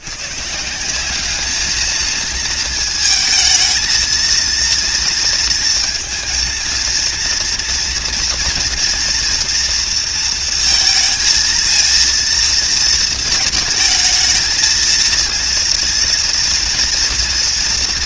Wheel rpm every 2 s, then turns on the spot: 180, 220, 230, 230, 240, 230, 230, 220, 230.
none